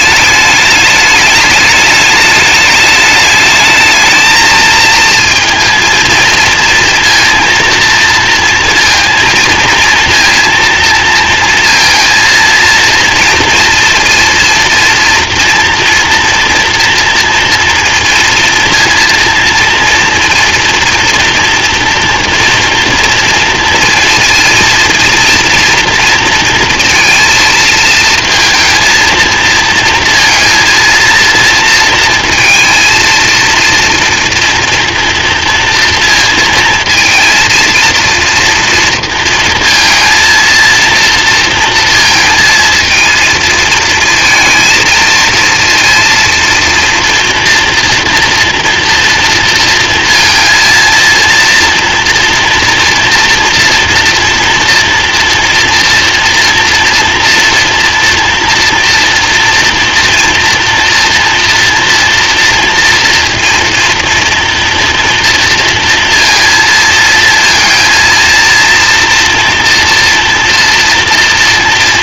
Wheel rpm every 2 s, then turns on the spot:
210, 210, 220, 230, 230, 230, 230, 230, 230, 230, 230, 230, 230, 230, 230, 230, 230, 230, 230, 230, 230, 220, 230, 230, 240, 230, 230, 240, 230, 230, 230, 230, 230, 230, 230, 230.
none